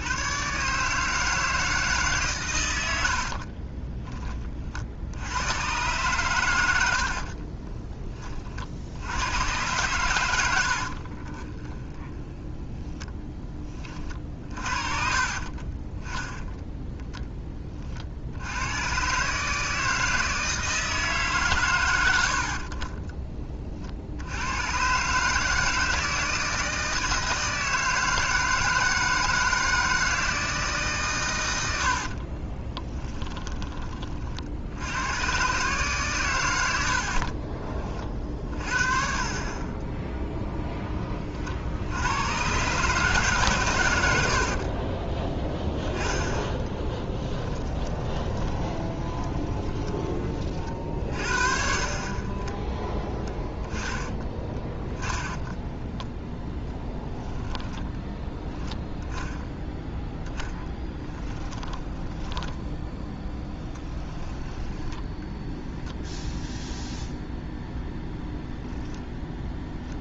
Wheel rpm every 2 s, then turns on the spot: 150, 80, 60, 70, 80, 50, 10, 50, 10, 120, 160, 40, 130, 160, 160, 150, 20, 100, 60, 40, 10, 140, 20, 10, 20, 50, 10, 30, 10, 0, 20, 20, 10, 0, 10.
10-12 32-34 36-38 46-50 56-58 60-62